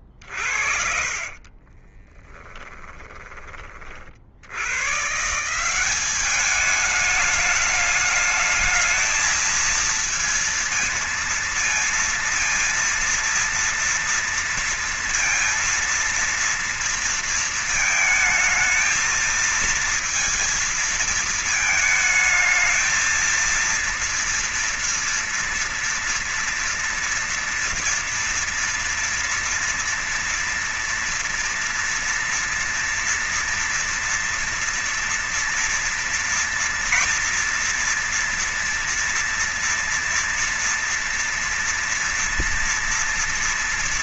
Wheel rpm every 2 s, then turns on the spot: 30, 20, 50, 190, 210, 230, 230, 230, 230, 220, 230, 220, 230, 230, 230, 230, 230, 240, 240, 240, 230, 230.
0-4